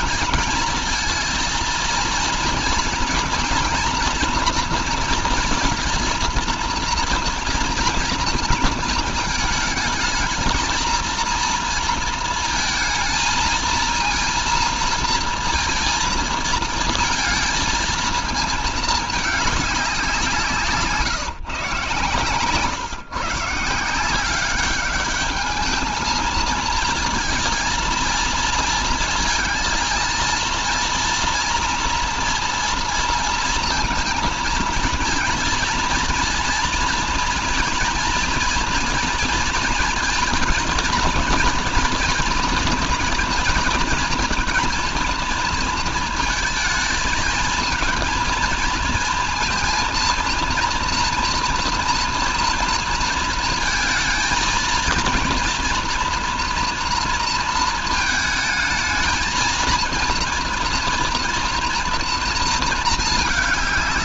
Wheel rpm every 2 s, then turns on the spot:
230, 230, 230, 230, 230, 220, 230, 230, 230, 220, 160, 140, 200, 220, 230, 230, 230, 230, 230, 230, 230, 240, 230, 220, 230, 230, 230, 230, 230, 220, 230, 230.
none